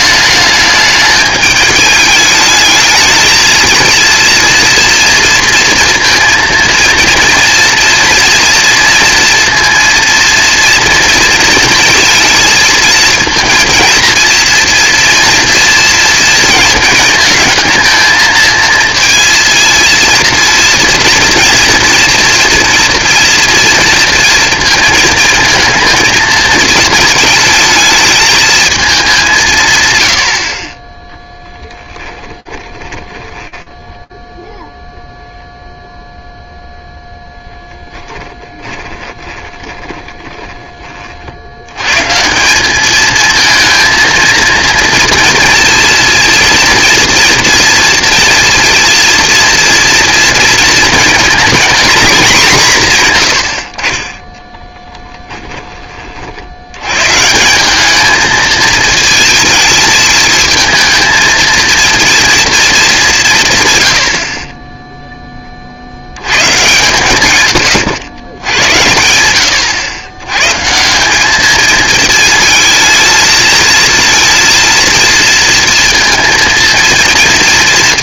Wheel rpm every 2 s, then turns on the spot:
210, 220, 230, 230, 230, 230, 220, 230, 220, 230, 230, 230, 230, 220, 200, 20, 20, 0, 0, 30, 40, 210, 230, 230, 230, 230, 140, 10, 130, 220, 220, 190, 10, 120, 100, 200, 220, 230, 240.
32-34 38-40 52-56